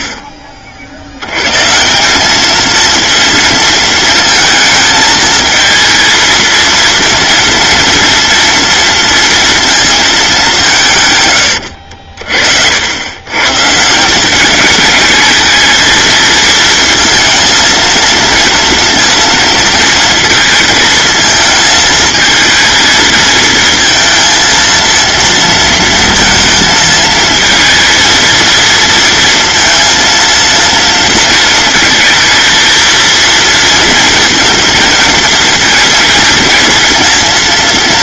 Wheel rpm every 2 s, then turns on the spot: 50, 220, 220, 230, 230, 160, 80, 210, 230, 230, 230, 220, 230, 220, 230, 230, 230, 230, 230.
none